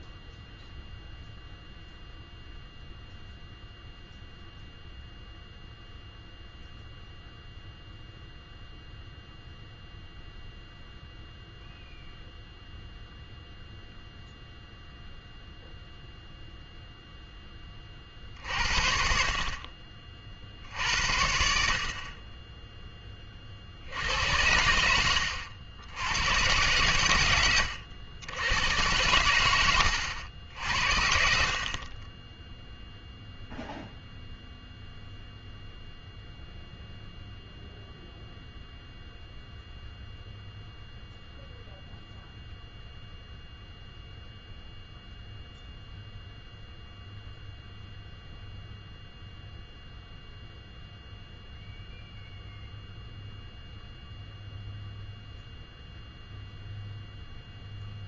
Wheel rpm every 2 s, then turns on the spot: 0, 0, 0, 0, 0, 0, 0, 0, 0, 50, 60, 20, 90, 110, 100, 80, 10, 0, 0, 0, 0, 0, 0, 0, 0, 0, 0, 0, 0.
none